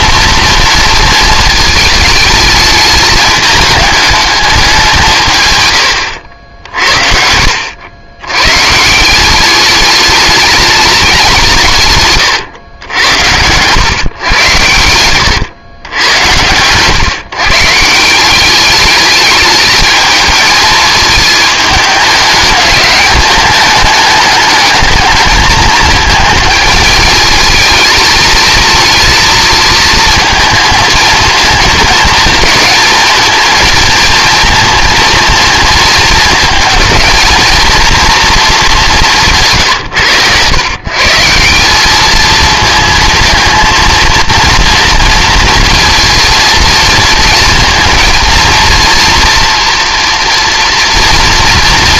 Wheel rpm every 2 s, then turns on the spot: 230, 210, 170, 60, 160, 210, 100, 100, 120, 210, 220, 200, 220, 220, 230, 220, 230, 230, 230, 210, 140, 220, 230, 230, 230, 230.
none